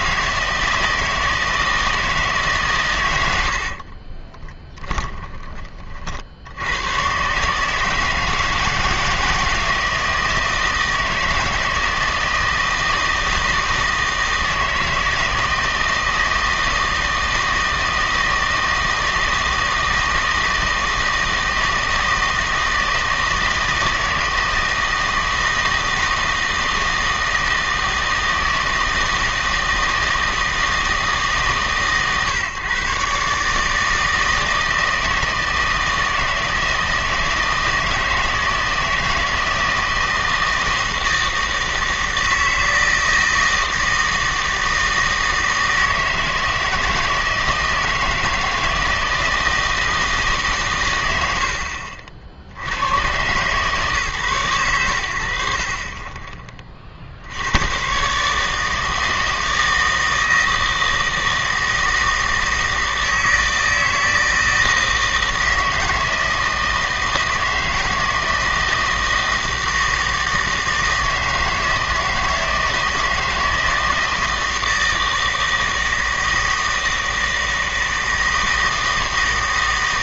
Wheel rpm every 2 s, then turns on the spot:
160, 130, 20, 90, 160, 160, 160, 160, 160, 160, 160, 160, 160, 160, 160, 160, 130, 160, 160, 160, 160, 160, 160, 160, 160, 130, 80, 110, 30, 150, 160, 160, 160, 160, 160, 160, 160, 160, 160, 160.
4-6